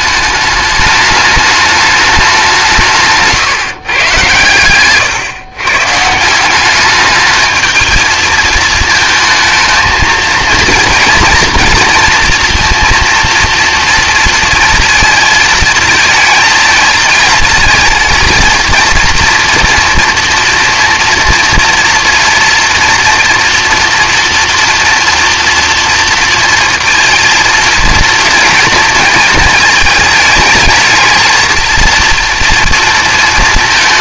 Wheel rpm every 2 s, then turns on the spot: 210, 160, 120, 200, 220, 230, 230, 220, 220, 230, 230, 240, 240, 230, 230, 220, 230.
none